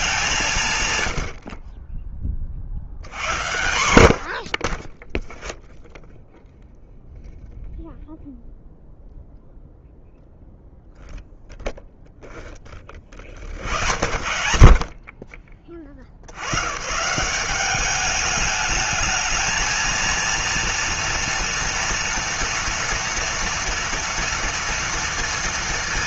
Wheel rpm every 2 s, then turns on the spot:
160, 40, 60, 0, 0, 0, 10, 50, 90, 210, 230, 230, 230.
none